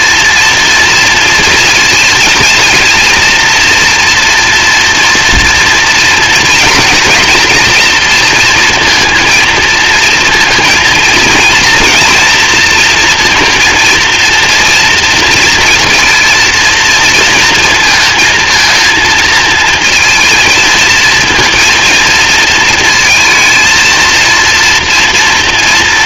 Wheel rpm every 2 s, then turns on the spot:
230, 230, 240, 230, 230, 220, 230, 230, 230, 230, 220, 230, 230.
none